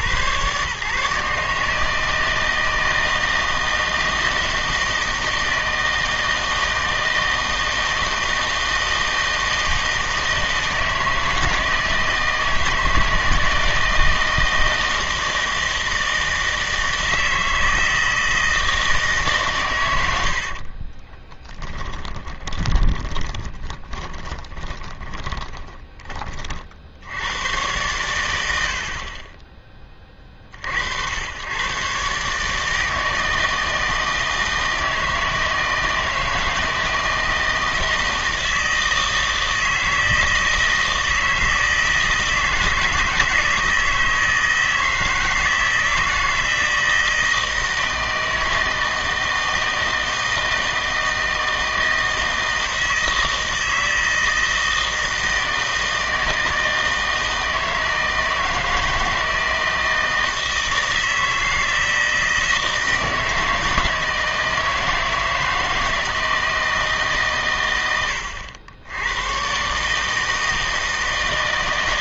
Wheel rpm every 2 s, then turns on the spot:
140, 160, 160, 160, 160, 160, 160, 160, 160, 160, 30, 30, 20, 60, 80, 60, 150, 160, 160, 160, 160, 160, 160, 160, 160, 160, 160, 160, 160, 160, 160, 160, 160, 160, 90, 160.
20-26